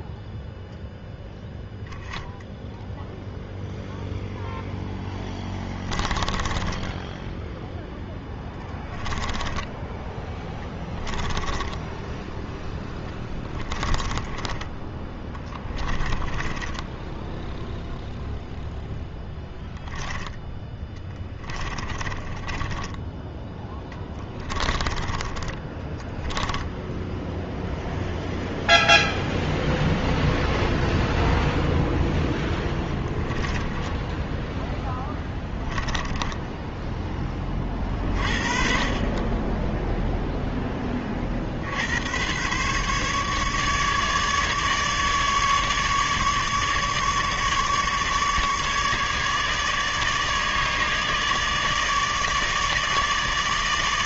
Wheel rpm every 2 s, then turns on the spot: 0, 0, 0, 10, 10, 10, 10, 10, 10, 0, 10, 20, 20, 10, 0, 0, 10, 0, 10, 40, 10, 140, 150, 150, 150, 150, 150.
6-8 10-14 16-18 20-26 32-34